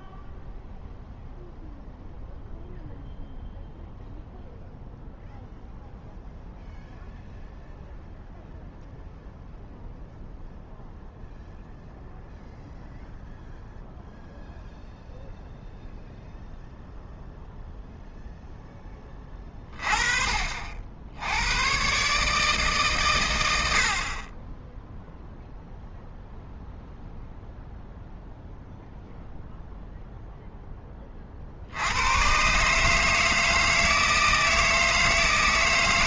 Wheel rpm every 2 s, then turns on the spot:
0, 0, 0, 0, 0, 0, 0, 0, 0, 10, 60, 140, 0, 0, 0, 10, 140, 160.
none